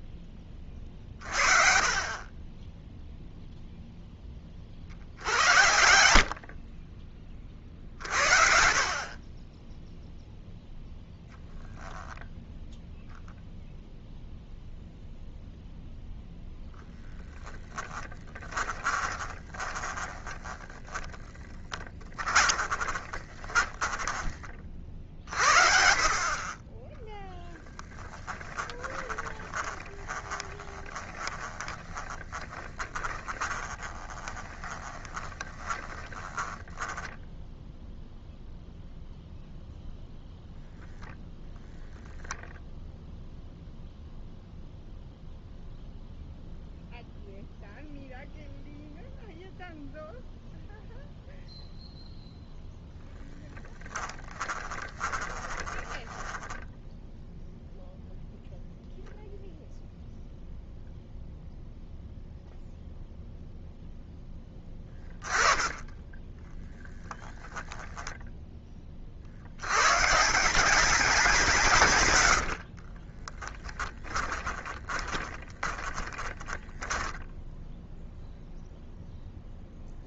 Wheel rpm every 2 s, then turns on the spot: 40, 0, 50, 30, 40, 0, 0, 0, 0, 20, 10, 30, 50, 20, 30, 20, 20, 20, 10, 0, 0, 0, 0, 0, 0, 0, 0, 20, 10, 0, 0, 0, 10, 10, 40, 190, 40, 20, 10, 0.
18-24 28-38 54-56 72-78